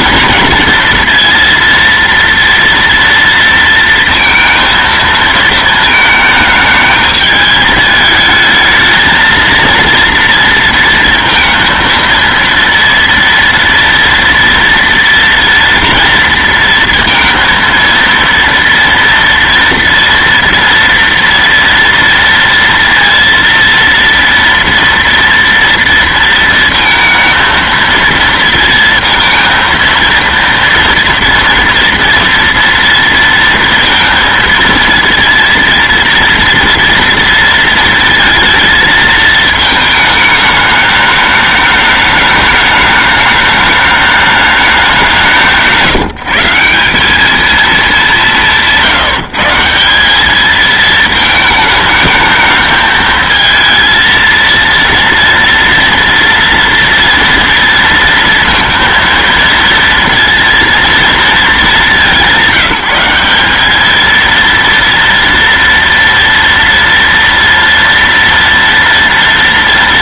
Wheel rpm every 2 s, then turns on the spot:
230, 230, 230, 220, 220, 230, 230, 230, 230, 230, 230, 230, 230, 230, 230, 230, 230, 230, 230, 230, 210, 210, 210, 170, 190, 200, 220, 230, 230, 230, 230, 200, 220, 230, 230.
none